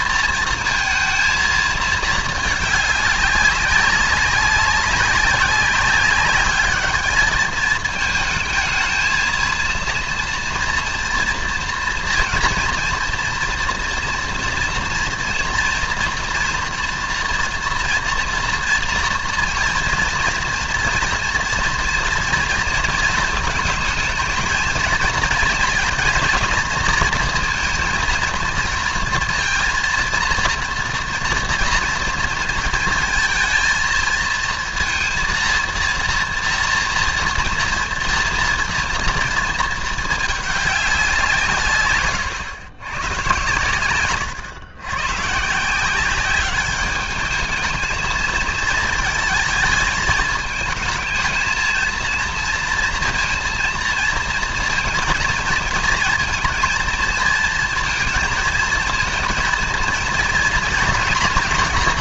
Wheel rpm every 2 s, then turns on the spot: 230, 210, 190, 210, 220, 230, 230, 240, 230, 230, 230, 230, 230, 230, 230, 230, 230, 230, 230, 230, 200, 100, 120, 210, 220, 220, 230, 230, 230, 230, 230.
none